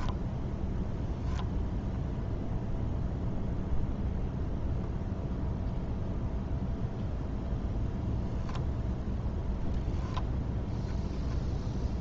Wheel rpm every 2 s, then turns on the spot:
0, 0, 0, 0, 10, 0.
none